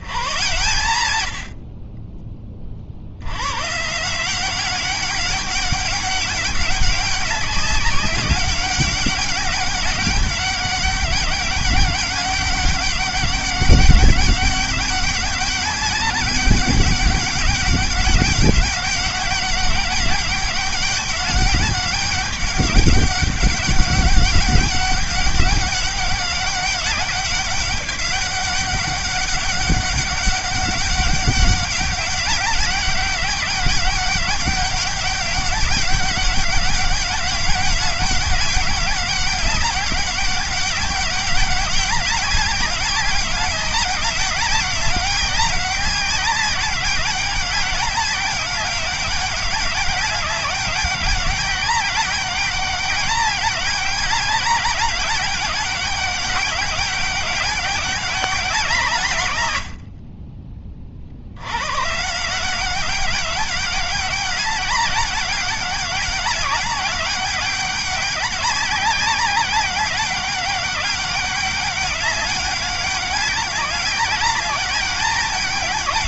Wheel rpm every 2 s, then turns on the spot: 110, 60, 190, 190, 200, 200, 200, 190, 200, 200, 200, 200, 200, 200, 200, 190, 200, 190, 200, 200, 200, 200, 200, 200, 200, 200, 200, 210, 200, 160, 40, 190, 200, 200, 190, 200, 200, 200.
none